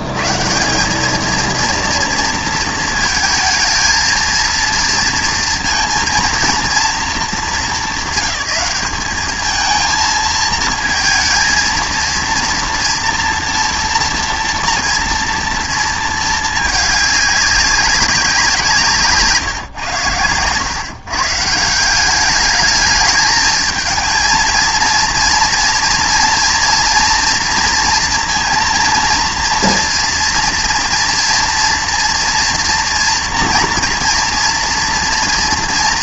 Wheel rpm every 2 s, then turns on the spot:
160, 220, 230, 220, 200, 220, 230, 230, 210, 170, 120, 220, 230, 240, 230, 230, 240, 230.
none